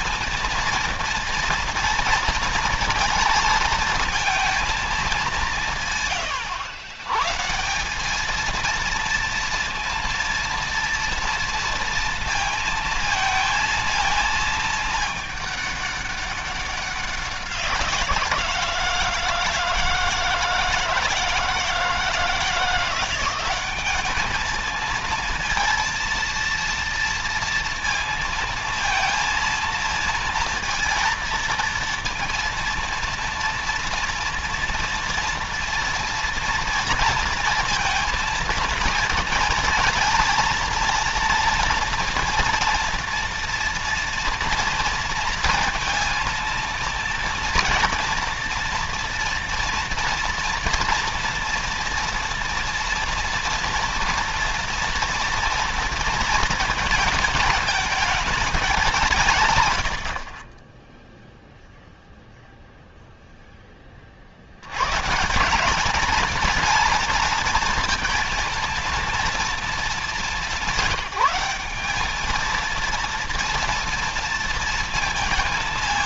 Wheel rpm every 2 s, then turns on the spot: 230, 230, 230, 120, 230, 230, 230, 220, 200, 170, 160, 170, 220, 230, 220, 230, 230, 230, 230, 230, 230, 230, 230, 230, 230, 230, 230, 230, 220, 200, 30, 0, 80, 230, 230, 190, 220, 230.
none